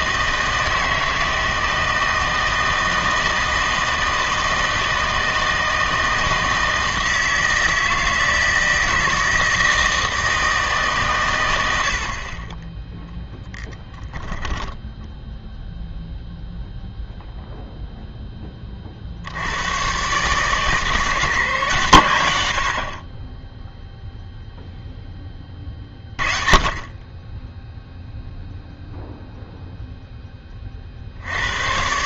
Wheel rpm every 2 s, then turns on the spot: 160, 160, 160, 160, 160, 150, 20, 10, 0, 30, 150, 70, 0, 30, 0, 40.
none